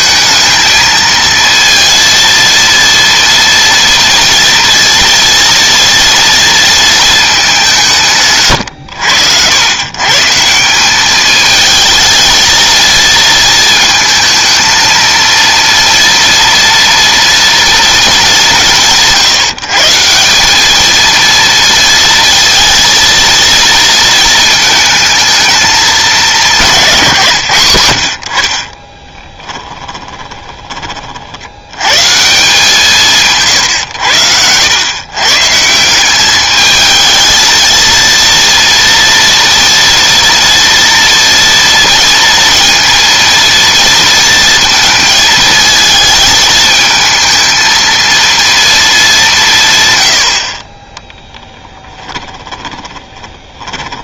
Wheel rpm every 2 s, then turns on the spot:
220, 230, 230, 230, 120, 180, 220, 230, 230, 180, 200, 230, 220, 170, 30, 20, 170, 100, 210, 230, 230, 230, 230, 220, 230, 40, 20.
52-54